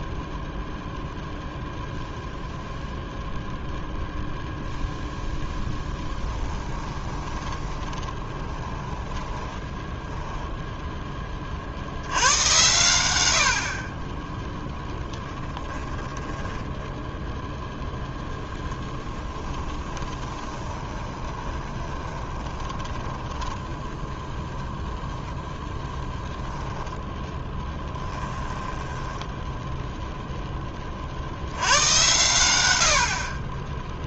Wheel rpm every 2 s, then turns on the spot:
0, 0, 0, 20, 20, 10, 120, 0, 10, 10, 20, 20, 0, 10, 10, 10, 90.
6-10 16-24 28-30